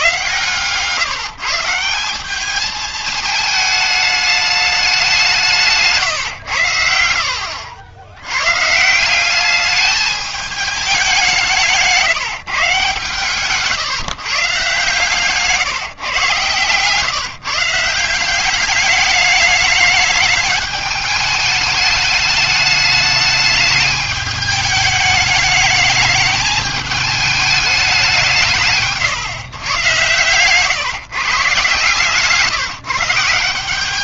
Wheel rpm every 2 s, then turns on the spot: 130, 210, 210, 100, 140, 210, 140, 140, 130, 200, 210, 210, 210, 210, 150, 130, 150.
16-18